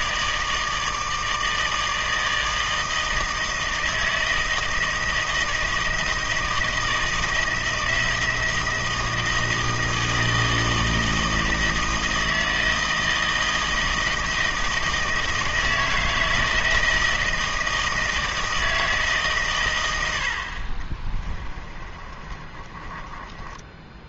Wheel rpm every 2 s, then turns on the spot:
160, 160, 160, 160, 160, 160, 160, 160, 160, 160, 40, 30.
20-24